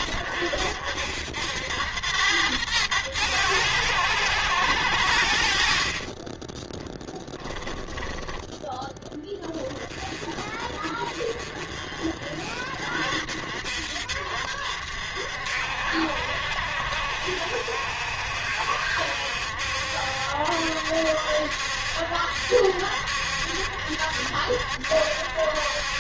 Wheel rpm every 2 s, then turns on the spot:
60, 100, 90, 20, 20, 30, 50, 60, 60, 60, 70, 70, 70.
6-10